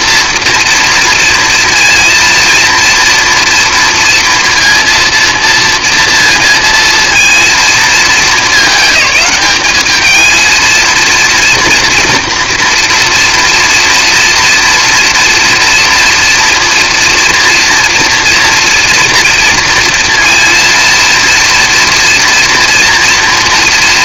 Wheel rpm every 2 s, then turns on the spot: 230, 230, 230, 230, 200, 230, 230, 230, 240, 230, 230, 230.
none